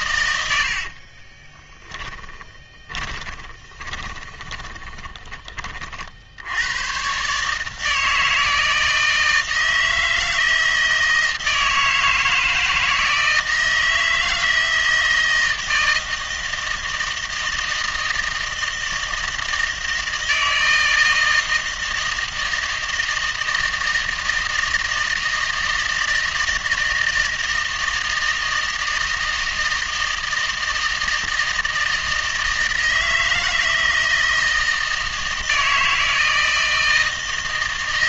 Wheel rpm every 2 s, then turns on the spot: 50, 30, 20, 110, 160, 160, 160, 160, 160, 160, 160, 160, 160, 160, 160, 160, 160, 160, 160.
0-6